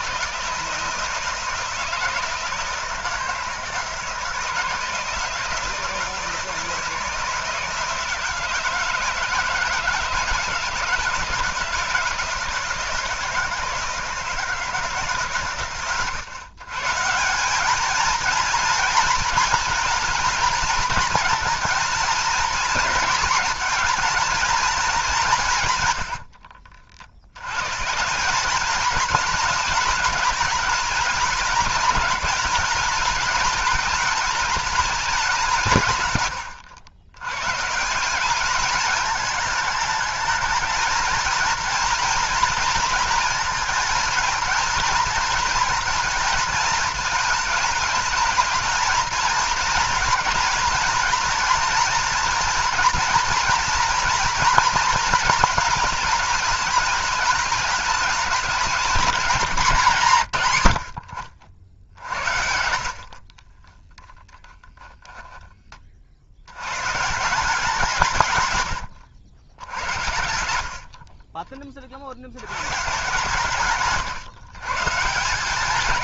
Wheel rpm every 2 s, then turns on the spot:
160, 160, 160, 160, 160, 160, 160, 160, 140, 230, 220, 240, 220, 60, 220, 210, 210, 210, 90, 210, 230, 230, 220, 230, 230, 230, 230, 230, 210, 210, 90, 70, 0, 120, 120, 70, 140, 150.
62-64 68-70